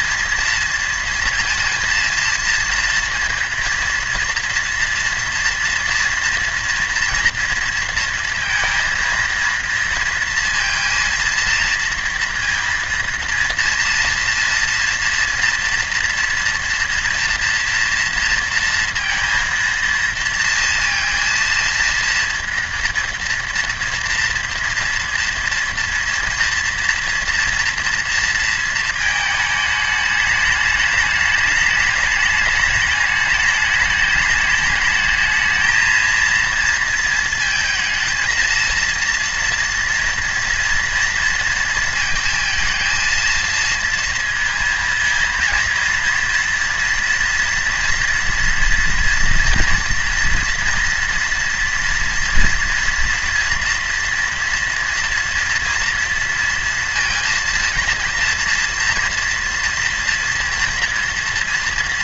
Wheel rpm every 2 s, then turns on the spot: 230, 230, 230, 230, 230, 230, 230, 230, 230, 230, 230, 240, 230, 230, 230, 210, 210, 210, 230, 230, 240, 230, 230, 230, 230, 230, 230, 230, 230, 230, 240.
none